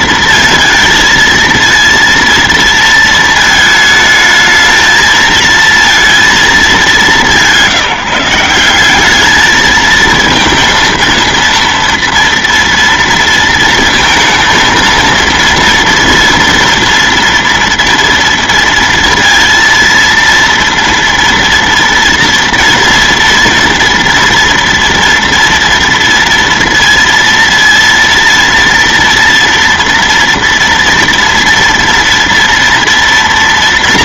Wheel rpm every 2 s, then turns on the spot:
230, 230, 220, 210, 180, 230, 230, 230, 230, 230, 230, 230, 230, 230, 230, 230, 230.
none